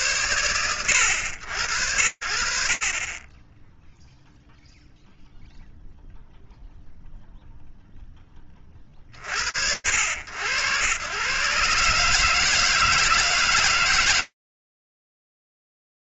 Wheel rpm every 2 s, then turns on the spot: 80, 20, 0, 0, 80, 140, 160, 60.
none